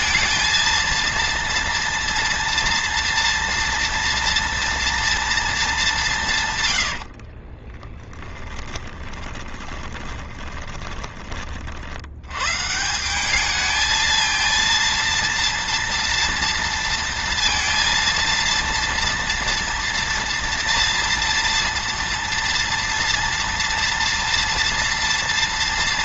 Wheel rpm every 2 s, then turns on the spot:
230, 230, 230, 110, 10, 20, 150, 230, 230, 230, 230, 230, 230.
6-12